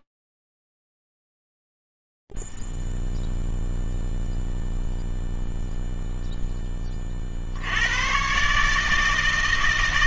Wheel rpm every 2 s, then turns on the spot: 0, 0, 0, 0, 110.
none